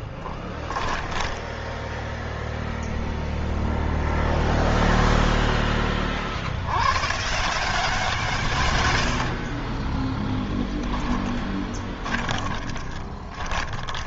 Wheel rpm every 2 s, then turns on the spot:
10, 0, 0, 70, 150, 10, 30.
0-2 10-14